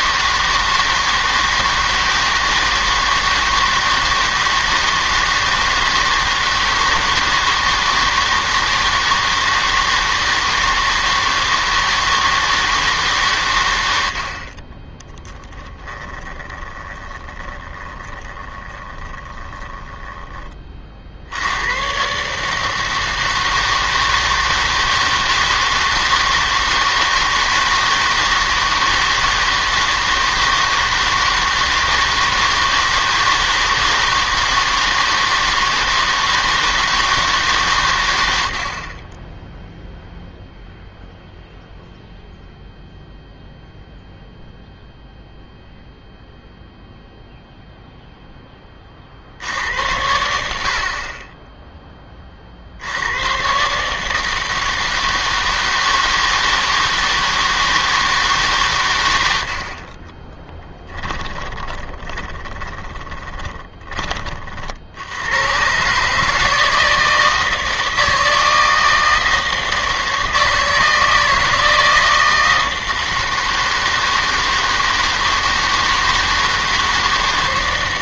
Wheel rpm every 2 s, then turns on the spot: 160, 160, 160, 160, 160, 160, 160, 40, 20, 20, 40, 160, 160, 160, 160, 160, 160, 160, 160, 70, 0, 0, 0, 0, 10, 60, 60, 160, 160, 130, 10, 20, 50, 160, 160, 160, 160, 160, 160.
16-20 62-64